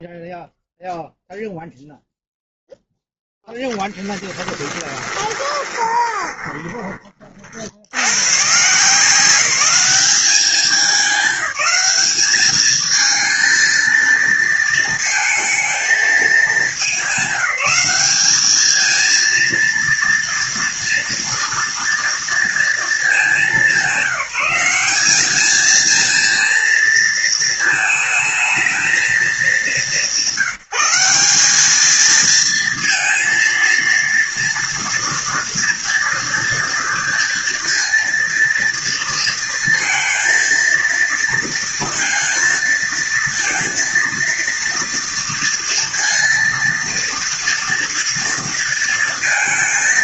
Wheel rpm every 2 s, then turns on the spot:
0, 0, 20, 20, 160, 200, 220, 230, 220, 220, 230, 220, 190, 230, 230, 180, 230, 230, 230, 230, 230, 230, 230, 230, 230.
4-6